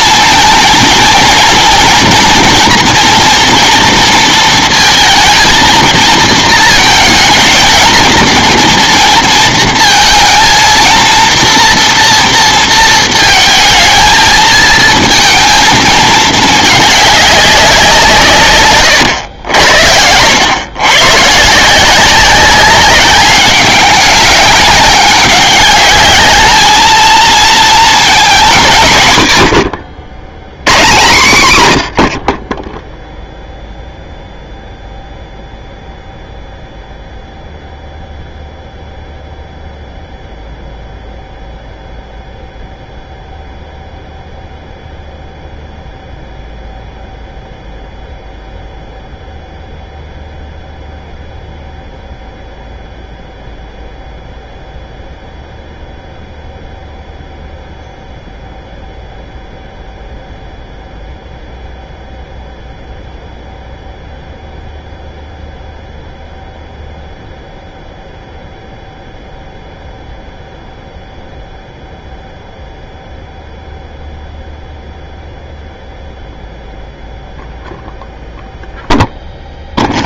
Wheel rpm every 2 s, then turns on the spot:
230, 240, 230, 220, 230, 230, 230, 220, 210, 130, 110, 190, 200, 210, 190, 130, 20, 0, 0, 0, 0, 0, 0, 0, 0, 0, 0, 0, 0, 0, 0, 0, 0, 0, 0, 0, 0, 0, 0, 0.
none